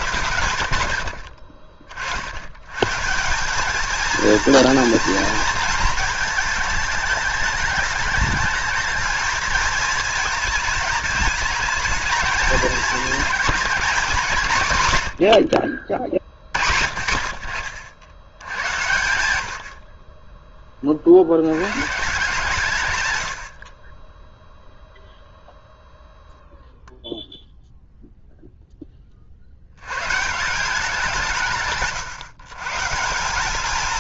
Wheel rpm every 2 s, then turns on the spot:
80, 130, 230, 210, 210, 220, 220, 120, 50, 100, 20, 130, 0, 0, 10, 170, 130.
none